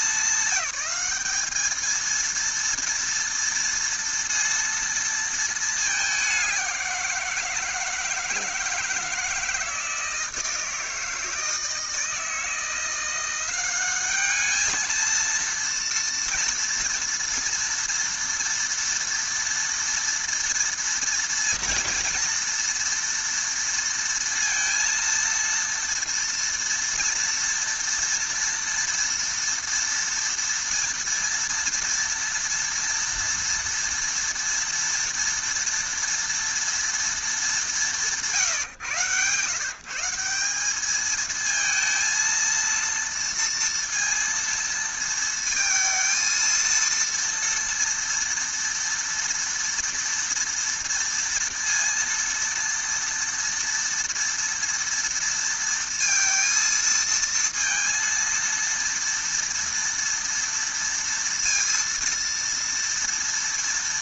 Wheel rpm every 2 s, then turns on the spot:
210, 230, 230, 170, 160, 160, 170, 220, 230, 230, 230, 230, 230, 230, 230, 240, 230, 230, 230, 140, 220, 230, 230, 230, 230, 230, 230, 230, 230, 230, 230, 230.
none